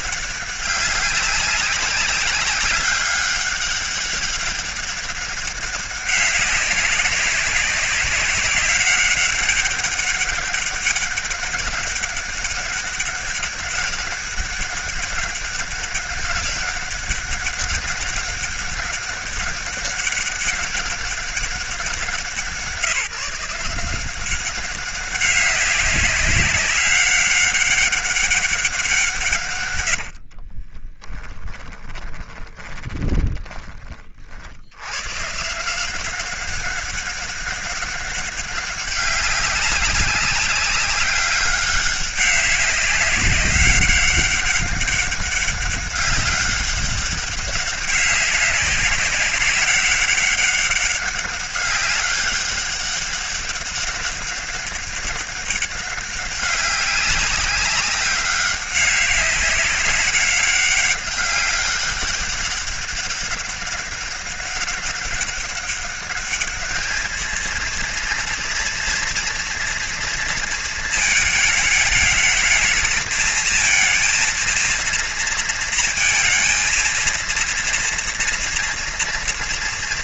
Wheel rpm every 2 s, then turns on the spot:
200, 200, 200, 190, 190, 200, 200, 200, 200, 200, 200, 170, 200, 200, 180, 30, 20, 100, 190, 190, 200, 200, 200, 190, 190, 200, 200, 200, 200, 190, 200, 200, 200, 210, 230, 220, 220, 230, 230, 230.
30-34